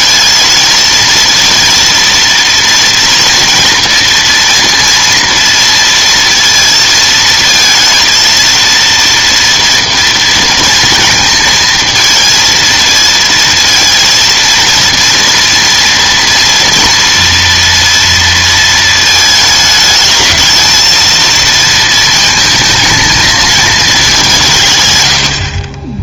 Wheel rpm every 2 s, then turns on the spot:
230, 230, 230, 230, 230, 230, 230, 230, 230, 230, 230, 220, 130.
none